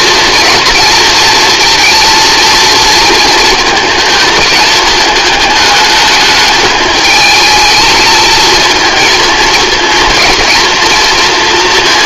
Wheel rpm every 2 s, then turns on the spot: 230, 220, 210, 220, 230, 230.
none